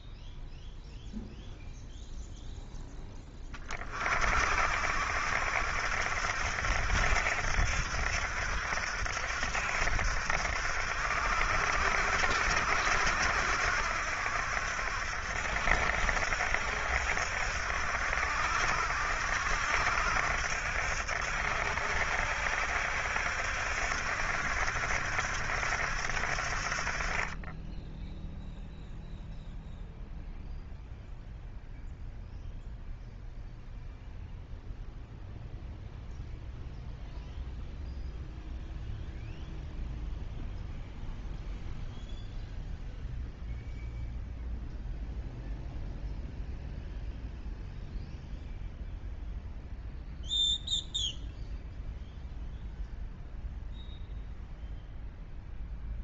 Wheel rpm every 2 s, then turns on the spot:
0, 0, 60, 70, 70, 70, 70, 70, 70, 70, 70, 70, 70, 40, 0, 0, 0, 0, 0, 0, 0, 0, 0, 0, 0, 0, 0, 0.
none